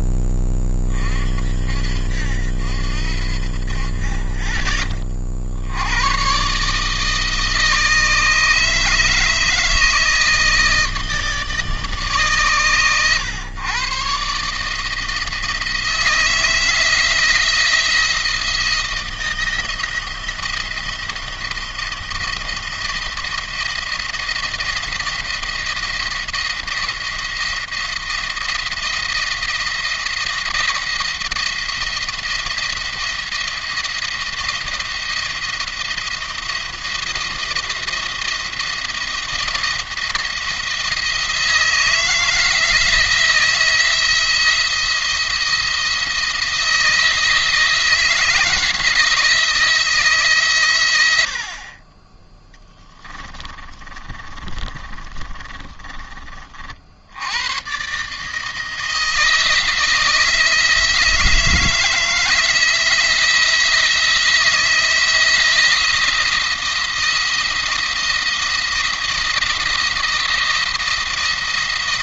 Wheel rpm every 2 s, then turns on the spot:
20, 70, 40, 140, 150, 160, 120, 150, 160, 170, 170, 170, 170, 170, 170, 160, 170, 170, 170, 170, 170, 170, 170, 160, 160, 110, 10, 20, 50, 160, 160, 160, 160, 170, 170, 170.
52-56